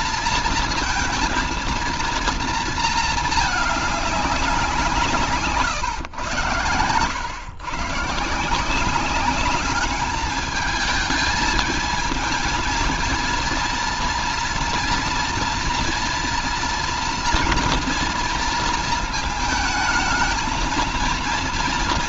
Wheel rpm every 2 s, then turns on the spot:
230, 230, 170, 110, 180, 210, 230, 230, 230, 230, 220.
none